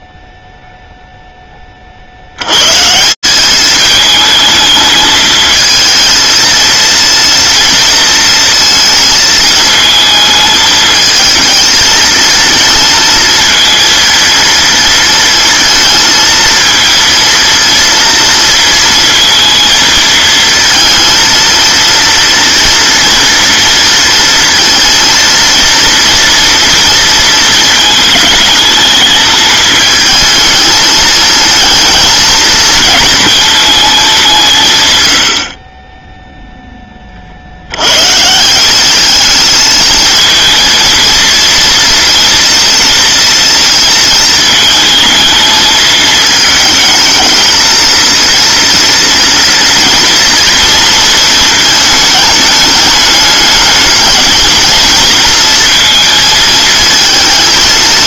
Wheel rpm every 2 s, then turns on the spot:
0, 70, 210, 220, 230, 220, 220, 230, 230, 230, 230, 230, 230, 230, 220, 220, 230, 210, 20, 150, 220, 230, 220, 220, 230, 230, 210, 220, 220.
none